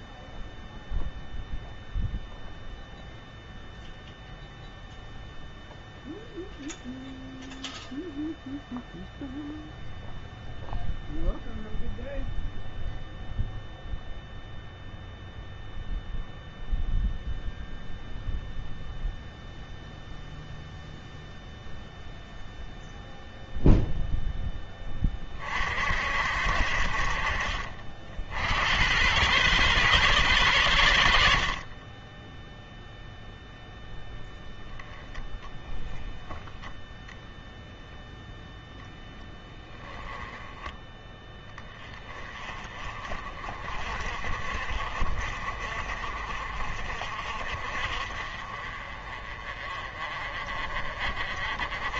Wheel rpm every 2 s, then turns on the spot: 0, 0, 0, 0, 0, 0, 0, 0, 0, 0, 0, 0, 20, 60, 100, 90, 0, 10, 0, 10, 10, 30, 40, 40, 30, 40.
none